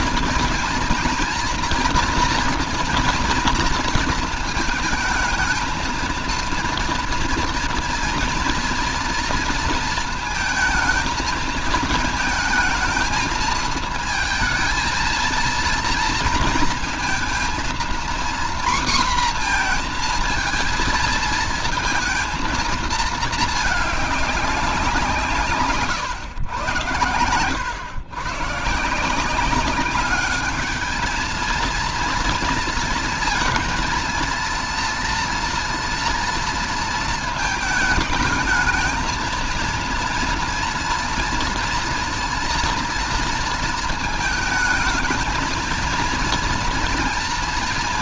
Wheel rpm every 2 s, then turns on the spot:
230, 240, 220, 230, 230, 230, 220, 230, 230, 240, 230, 230, 190, 110, 140, 210, 230, 230, 230, 220, 230, 230, 220, 240.
none